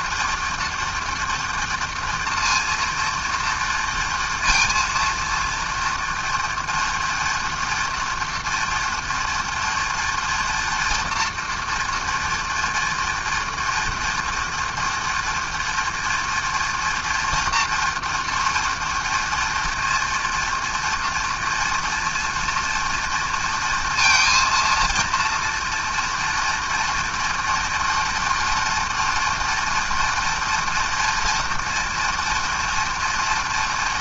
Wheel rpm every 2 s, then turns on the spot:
230, 230, 230, 240, 230, 230, 240, 230, 230, 230, 230, 230, 230, 240, 230, 230, 230.
none